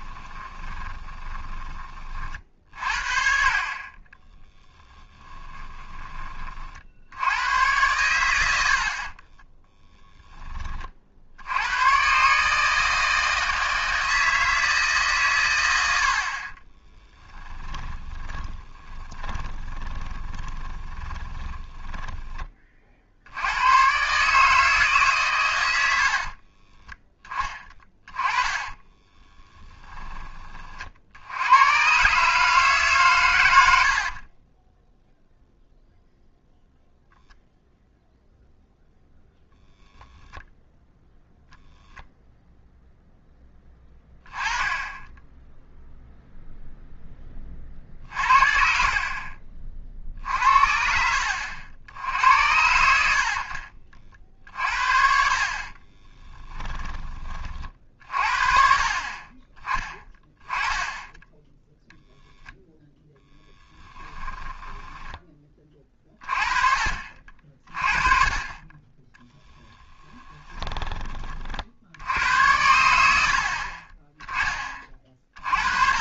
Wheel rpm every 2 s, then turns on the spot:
20, 50, 10, 50, 70, 40, 160, 160, 30, 20, 20, 40, 150, 20, 20, 40, 150, 10, 0, 0, 0, 0, 10, 0, 50, 60, 80, 60, 20, 40, 10, 0, 10, 40, 20, 20, 90, 30.
0-2 16-22 26-30 34-36 56-58 64-66